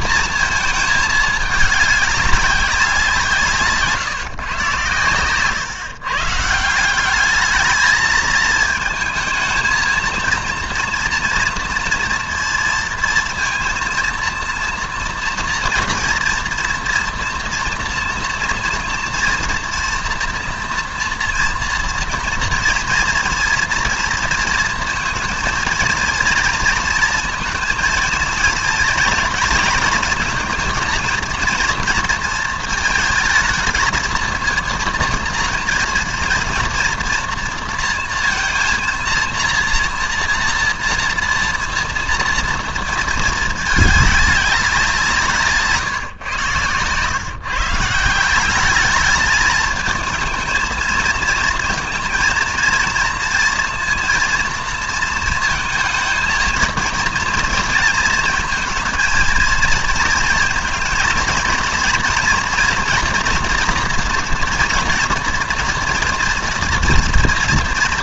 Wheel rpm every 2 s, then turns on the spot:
220, 190, 120, 160, 220, 230, 230, 230, 230, 230, 230, 230, 230, 230, 220, 230, 220, 230, 230, 230, 230, 230, 200, 120, 200, 220, 230, 230, 230, 230, 220, 230, 230, 240.
none